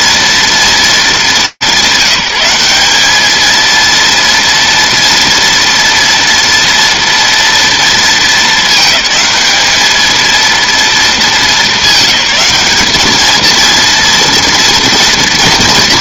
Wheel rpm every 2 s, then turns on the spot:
230, 200, 230, 230, 220, 220, 200, 230.
none